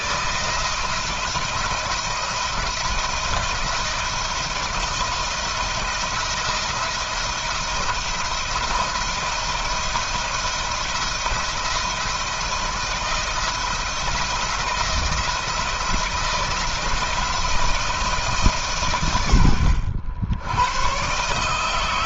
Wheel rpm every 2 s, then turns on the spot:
170, 170, 170, 170, 170, 170, 160, 170, 170, 120, 130.
none